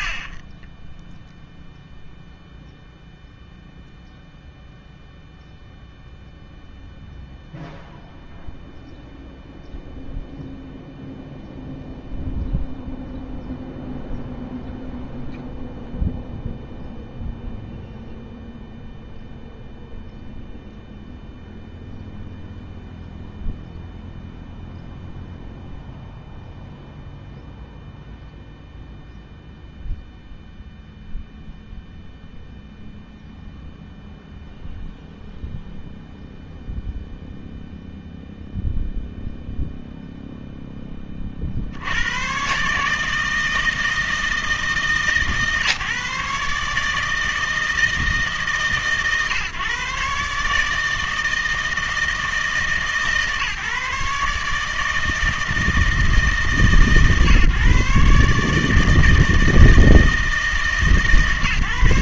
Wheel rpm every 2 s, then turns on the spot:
20, 0, 0, 0, 0, 0, 0, 0, 0, 0, 0, 0, 0, 0, 0, 0, 0, 0, 0, 0, 10, 150, 160, 150, 140, 150, 150, 160, 140, 150, 160.
0-2